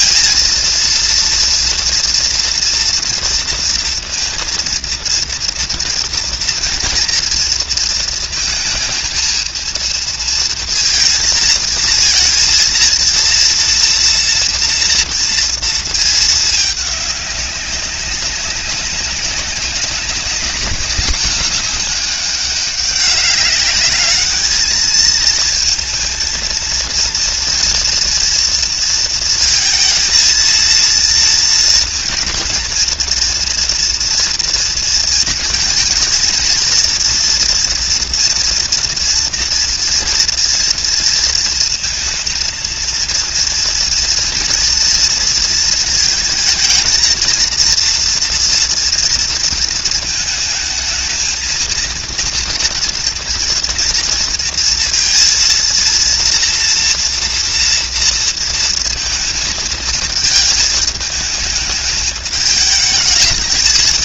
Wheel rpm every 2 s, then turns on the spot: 230, 230, 230, 230, 230, 230, 230, 230, 210, 190, 210, 200, 210, 230, 230, 230, 220, 230, 230, 230, 230, 230, 230, 220, 230, 220, 230, 230, 230, 230, 220, 210.
none